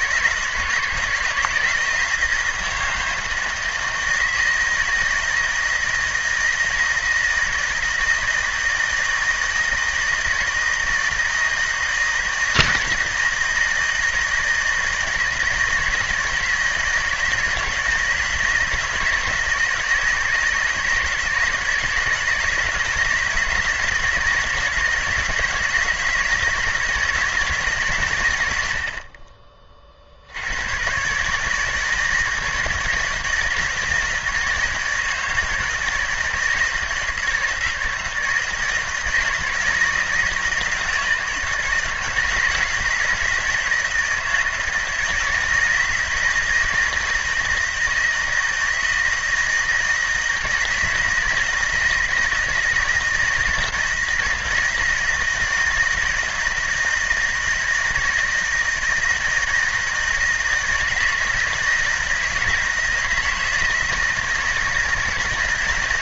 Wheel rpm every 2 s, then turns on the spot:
160, 160, 160, 160, 160, 160, 160, 160, 160, 160, 160, 160, 160, 170, 70, 100, 160, 160, 160, 160, 160, 160, 160, 160, 160, 160, 160, 160, 160, 160, 160, 160, 160.
none